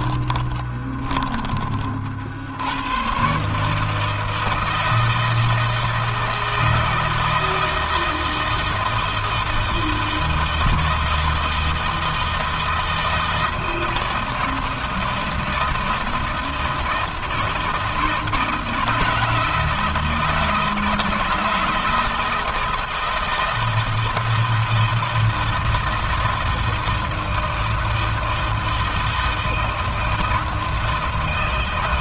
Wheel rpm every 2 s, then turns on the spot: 20, 110, 160, 160, 160, 160, 160, 160, 160, 160, 160, 160, 160, 160, 160, 160.
0-2